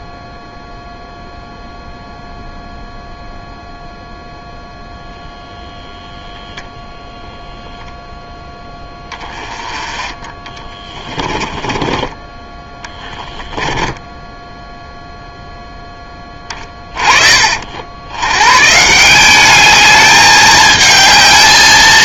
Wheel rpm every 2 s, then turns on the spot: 0, 0, 0, 10, 10, 20, 20, 10, 20, 130, 210.
10-12